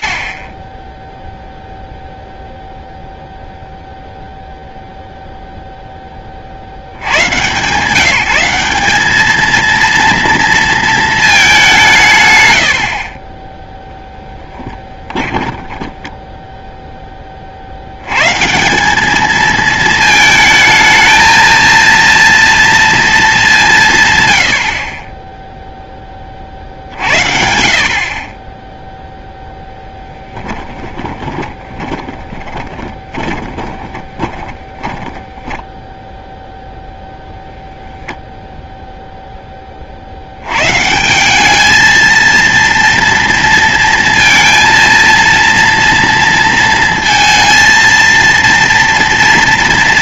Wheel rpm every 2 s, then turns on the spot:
0, 0, 10, 160, 230, 160, 10, 10, 90, 220, 230, 150, 20, 40, 10, 30, 20, 10, 0, 40, 210, 230, 230, 230, 230.
10-14 28-34